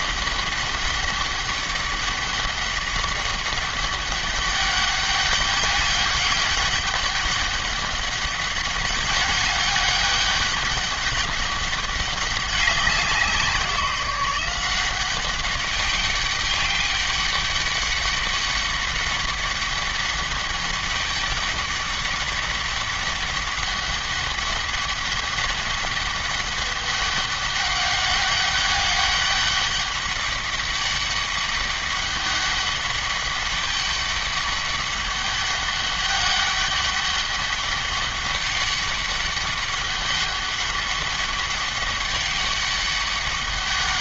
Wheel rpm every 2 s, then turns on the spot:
200, 200, 200, 200, 200, 200, 190, 180, 200, 200, 200, 200, 200, 200, 200, 200, 200, 200, 200, 200, 200, 200.
none